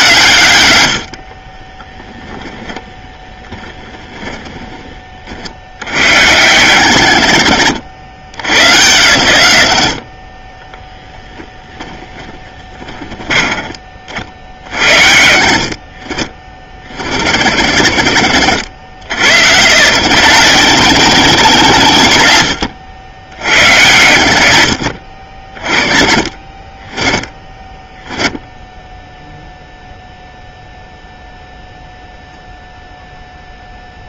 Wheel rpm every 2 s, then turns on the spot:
100, 10, 20, 100, 100, 20, 20, 70, 40, 90, 140, 80, 90, 30, 0, 0, 0.
2-4 12-14 22-24